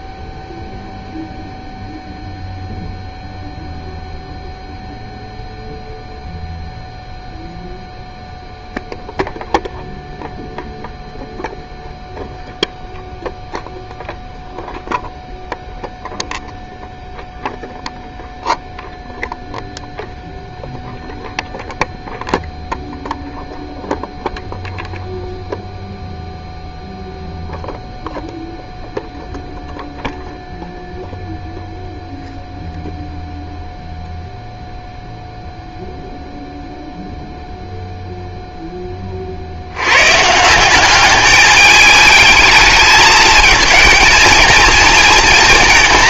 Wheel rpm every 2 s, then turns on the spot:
0, 0, 0, 0, 0, 0, 0, 0, 0, 0, 0, 0, 0, 0, 0, 0, 0, 0, 0, 10, 190, 220, 220.
none